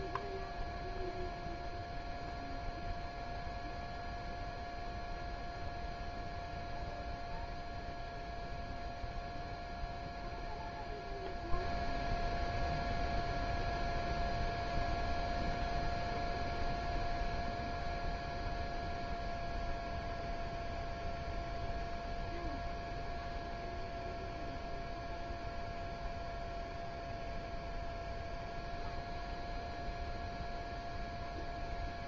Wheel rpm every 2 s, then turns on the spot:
0, 0, 0, 0, 0, 0, 0, 0, 0, 0, 0, 0, 0, 0, 0, 0.
none